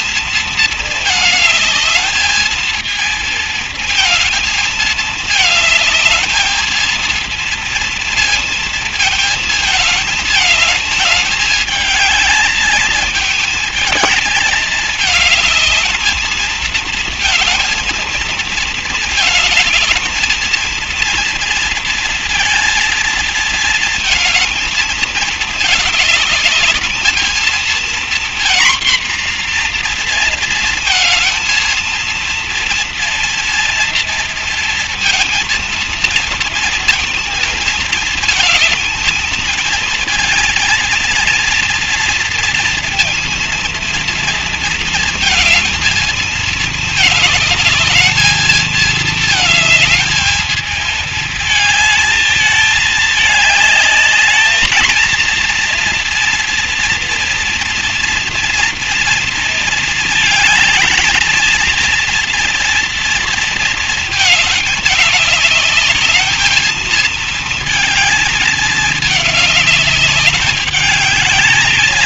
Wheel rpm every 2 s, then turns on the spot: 220, 210, 220, 220, 230, 220, 220, 220, 220, 220, 220, 230, 230, 220, 230, 230, 230, 230, 230, 220, 230, 230, 230, 220, 220, 220, 220, 210, 230, 230, 220, 230, 220, 220, 220, 210.
none